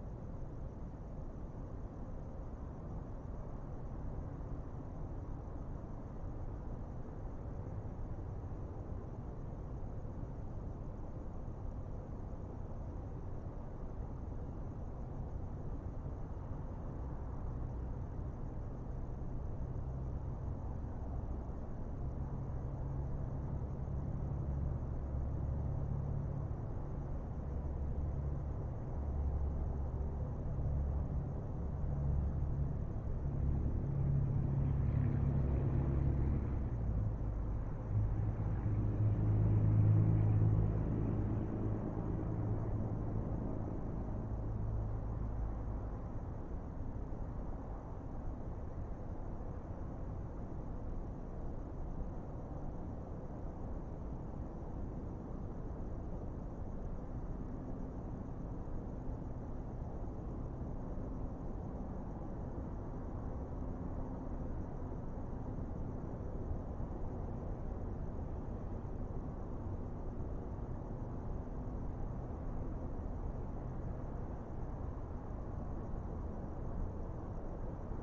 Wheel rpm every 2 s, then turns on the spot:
0, 0, 0, 0, 0, 0, 0, 0, 0, 0, 0, 0, 0, 0, 0, 0, 0, 0, 0, 0, 0, 0, 0, 0, 0, 0, 0, 0, 0, 0, 0, 0, 0, 0, 0, 0, 0, 0, 0.
none